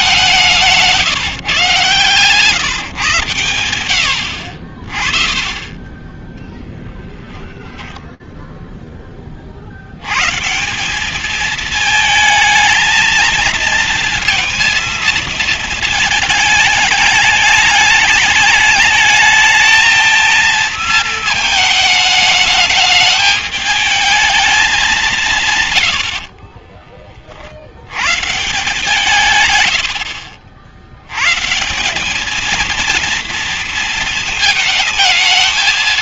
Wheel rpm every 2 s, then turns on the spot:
180, 130, 70, 20, 0, 150, 220, 230, 220, 210, 220, 210, 210, 40, 150, 70, 220, 220.
26-28